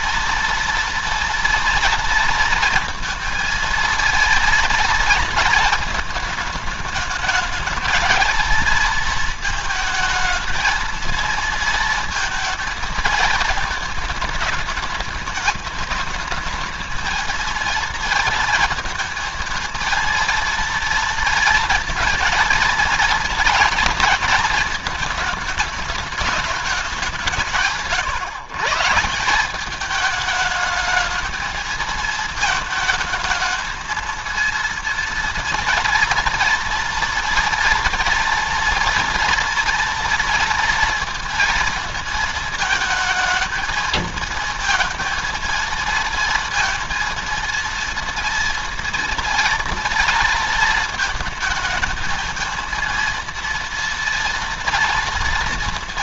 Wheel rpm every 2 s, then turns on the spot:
230, 230, 230, 220, 230, 230, 230, 220, 220, 220, 230, 230, 220, 200, 140, 210, 220, 230, 230, 230, 230, 220, 230, 230, 230, 230, 230, 230.
none